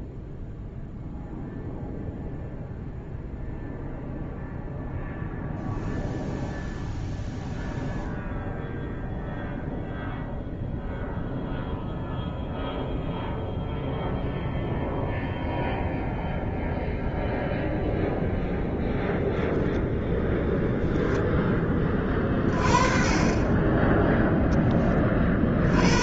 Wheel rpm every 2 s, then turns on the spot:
0, 0, 0, 0, 0, 0, 0, 0, 0, 0, 0, 30, 20.
none